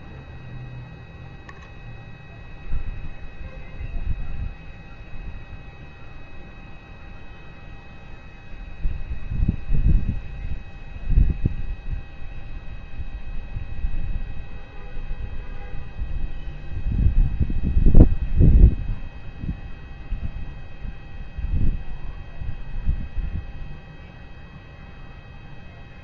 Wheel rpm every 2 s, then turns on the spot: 0, 0, 0, 0, 0, 0, 0, 0, 0, 0, 0, 0, 0.
none